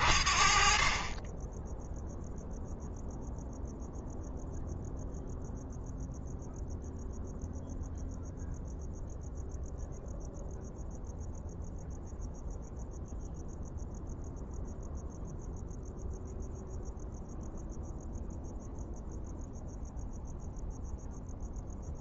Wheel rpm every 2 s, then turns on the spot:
30, 0, 0, 0, 0, 0, 0, 0, 0, 0, 0.
none